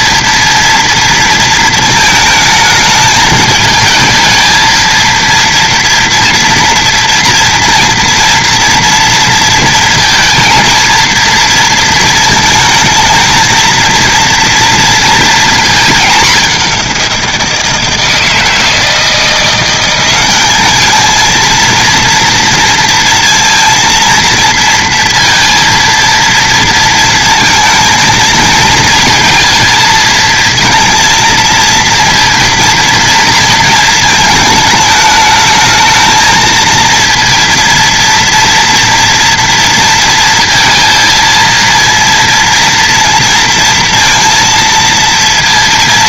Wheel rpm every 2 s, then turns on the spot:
230, 220, 220, 230, 230, 230, 220, 230, 190, 160, 210, 230, 230, 230, 230, 230, 230, 220, 230, 230, 230, 230, 230.
none